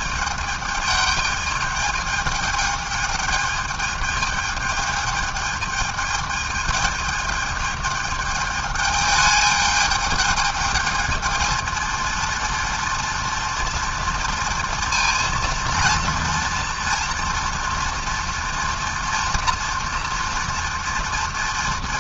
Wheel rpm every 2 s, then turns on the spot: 210, 210, 210, 210, 210, 220, 240, 230, 230, 230, 220.
none